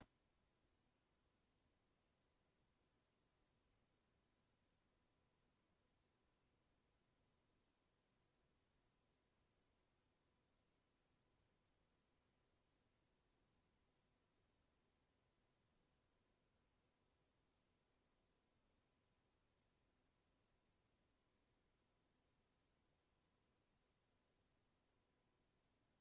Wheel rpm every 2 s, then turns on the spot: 0, 0, 0, 0, 0, 0, 0, 0, 0, 0, 0, 0, 0.
none